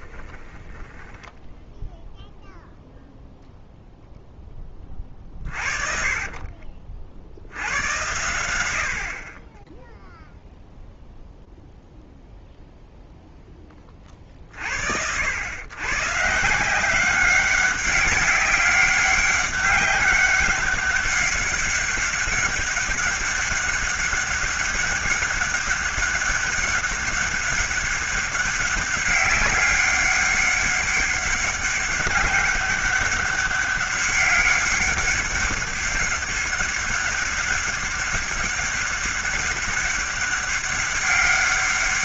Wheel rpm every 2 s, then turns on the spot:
20, 0, 20, 50, 90, 0, 0, 50, 160, 200, 200, 200, 200, 200, 200, 200, 200, 200, 200, 200, 200.
0-2 6-8